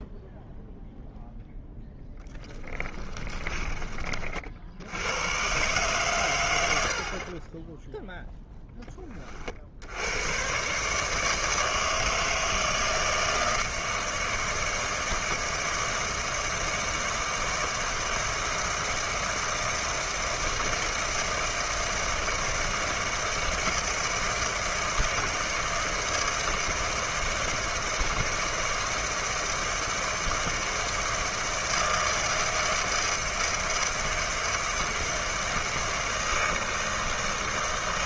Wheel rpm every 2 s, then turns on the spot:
0, 20, 70, 70, 10, 130, 160, 160, 160, 160, 160, 160, 160, 160, 160, 160, 160, 160, 160.
2-4